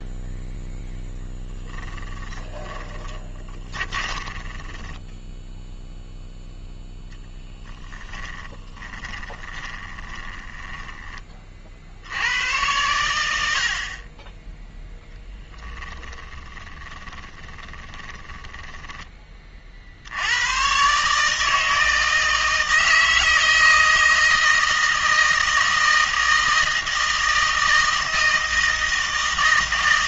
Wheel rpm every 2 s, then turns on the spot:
0, 20, 10, 0, 20, 20, 100, 10, 20, 10, 120, 160, 160, 160, 160.
2-6 8-12 16-20